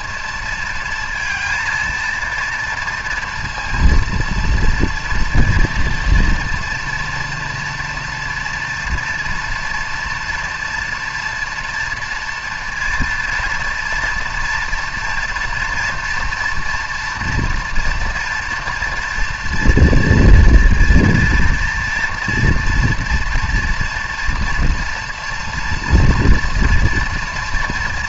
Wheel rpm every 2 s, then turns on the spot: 230, 230, 230, 230, 230, 240, 230, 230, 230, 230, 230, 230, 230, 230.
none